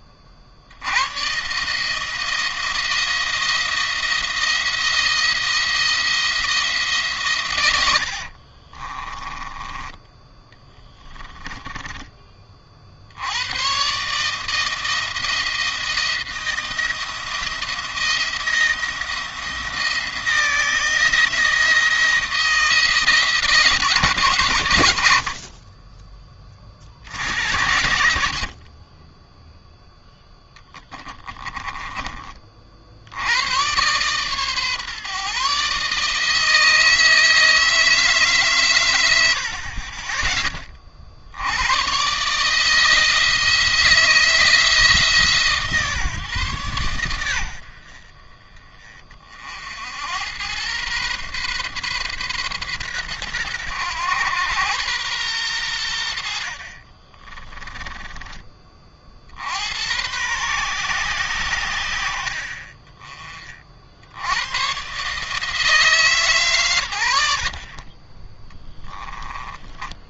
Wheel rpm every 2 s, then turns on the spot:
60, 170, 170, 160, 30, 10, 20, 160, 170, 170, 170, 160, 120, 40, 30, 10, 50, 140, 160, 110, 30, 150, 160, 120, 30, 110, 120, 110, 60, 30, 120, 30, 110, 120, 20.
8-12 30-32 56-58 68-70